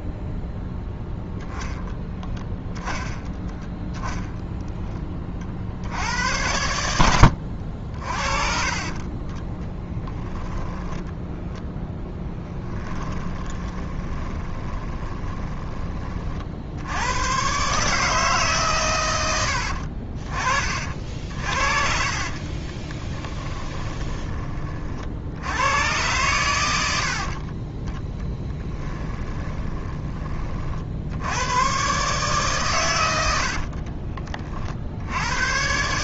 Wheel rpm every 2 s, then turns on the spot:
0, 20, 10, 80, 40, 0, 20, 20, 80, 130, 50, 30, 30, 90, 10, 50, 130, 50.
12-16 22-24 28-30